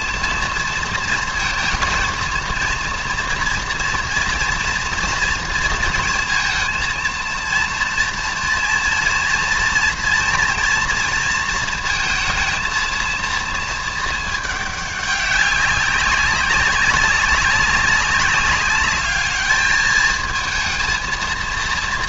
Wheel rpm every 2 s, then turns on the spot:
230, 230, 230, 230, 230, 240, 220, 210, 200, 210, 220.
none